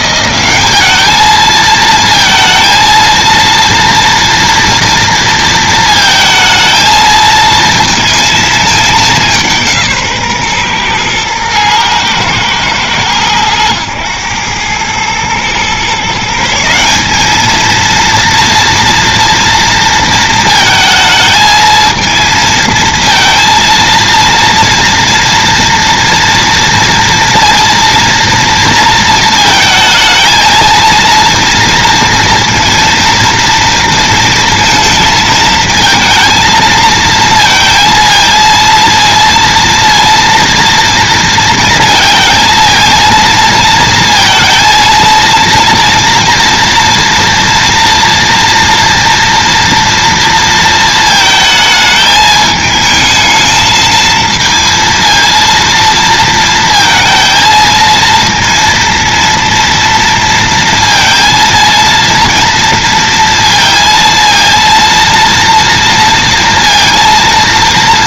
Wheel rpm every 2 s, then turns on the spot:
200, 230, 230, 220, 220, 130, 110, 100, 170, 230, 220, 230, 230, 230, 230, 230, 230, 230, 220, 230, 230, 230, 230, 230, 230, 220, 210, 230, 230, 230, 230, 230, 230, 230.
none